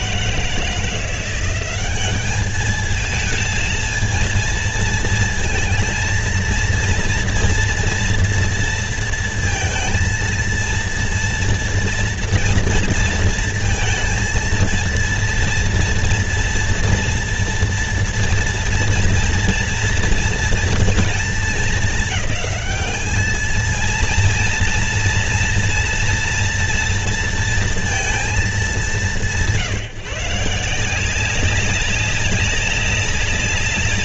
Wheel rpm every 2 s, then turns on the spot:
160, 210, 230, 230, 230, 230, 230, 230, 230, 230, 230, 210, 230, 240, 200, 160, 200.
none